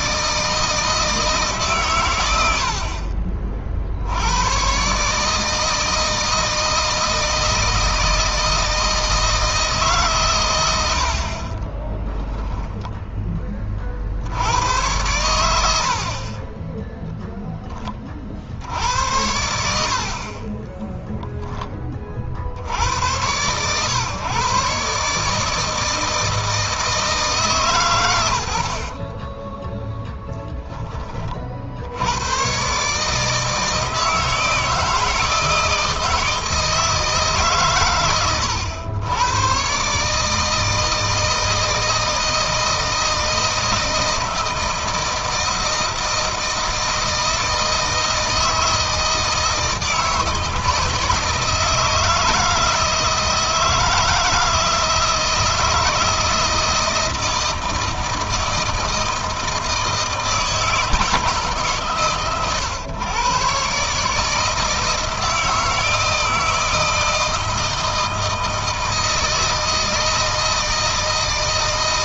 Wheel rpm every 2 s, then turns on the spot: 160, 70, 120, 160, 160, 100, 0, 100, 20, 70, 20, 80, 140, 160, 70, 10, 130, 160, 160, 100, 160, 160, 160, 160, 160, 160, 160, 160, 160, 160, 160, 120, 160, 160, 160, 160.
20-22 28-30